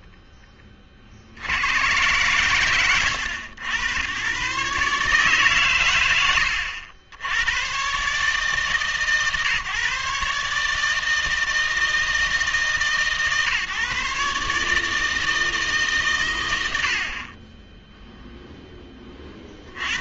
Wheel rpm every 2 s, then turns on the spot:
20, 110, 140, 80, 150, 150, 150, 150, 100, 10.
none